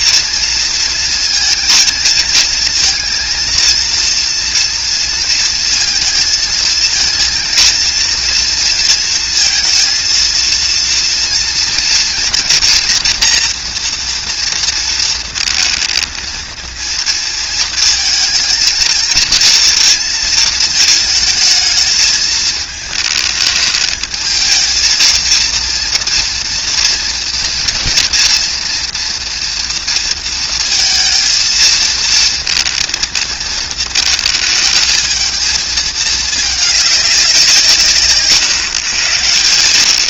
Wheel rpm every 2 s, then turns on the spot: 230, 220, 230, 220, 230, 230, 230, 230, 230, 230, 230, 220, 220, 240, 230, 230, 230, 220, 210, 120.
none